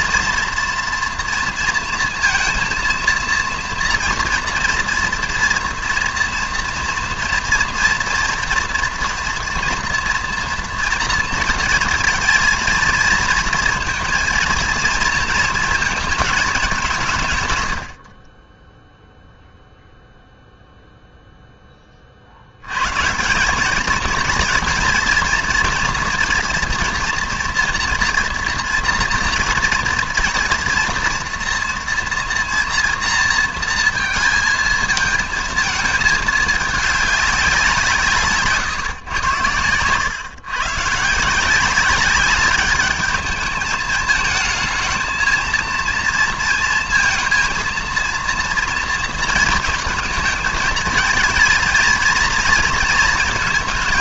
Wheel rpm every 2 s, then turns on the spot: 240, 230, 230, 240, 230, 230, 230, 230, 190, 10, 0, 100, 230, 230, 230, 240, 230, 230, 210, 140, 130, 210, 220, 230, 230, 230, 230.
none